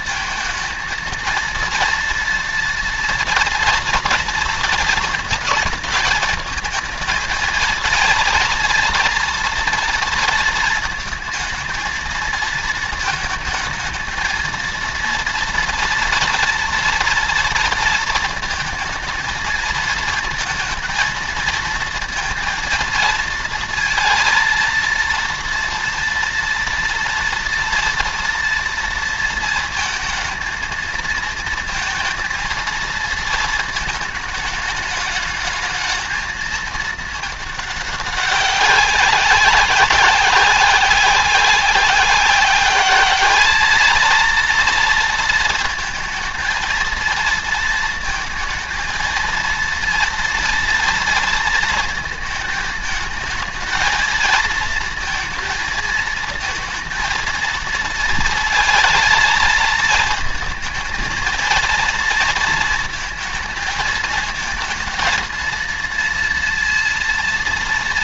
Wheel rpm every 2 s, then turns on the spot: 230, 230, 230, 220, 230, 230, 220, 230, 240, 220, 230, 230, 230, 230, 230, 220, 230, 220, 220, 190, 190, 200, 230, 230, 230, 230, 220, 220, 230, 230, 220, 230, 220, 230.
none